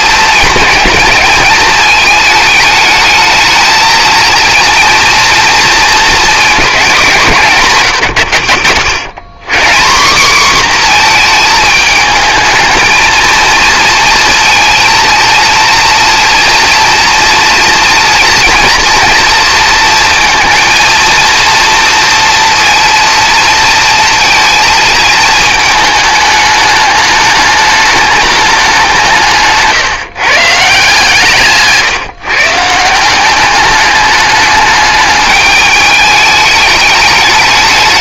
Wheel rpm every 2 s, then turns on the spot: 210, 210, 230, 210, 90, 240, 220, 220, 230, 230, 230, 240, 230, 210, 200, 150, 160, 210, 210.
none